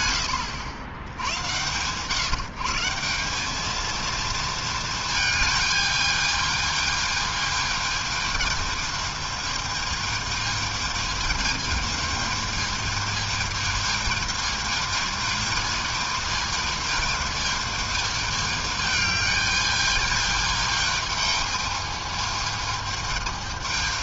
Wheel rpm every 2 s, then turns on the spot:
100, 190, 220, 220, 220, 220, 220, 220, 220, 210, 220, 220.
none